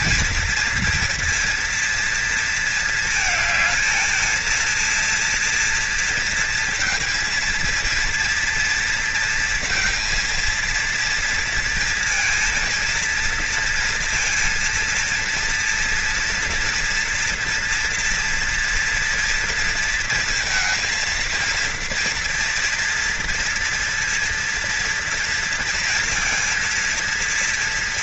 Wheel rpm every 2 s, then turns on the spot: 230, 220, 230, 230, 230, 230, 230, 230, 240, 240, 230, 230, 230, 230.
none